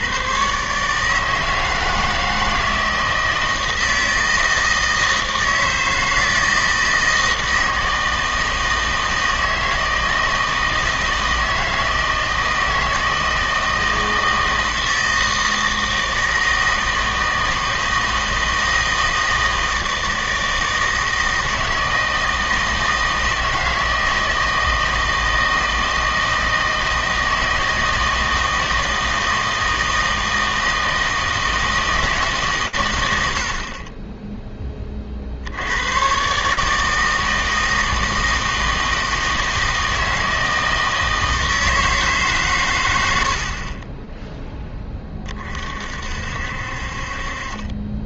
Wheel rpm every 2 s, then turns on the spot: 140, 160, 160, 160, 160, 160, 160, 160, 160, 160, 160, 160, 160, 160, 160, 160, 130, 20, 150, 160, 160, 110, 10, 60.
none